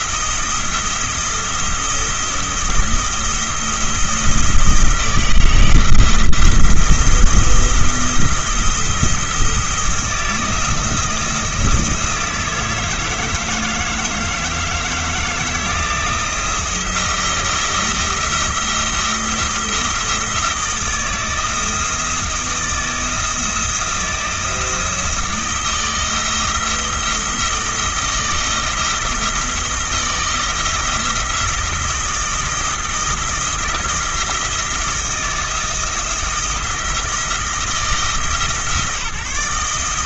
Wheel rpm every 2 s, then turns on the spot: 170, 170, 160, 170, 170, 170, 160, 160, 170, 170, 170, 160, 170, 160, 160, 170, 170, 170, 160, 150.
none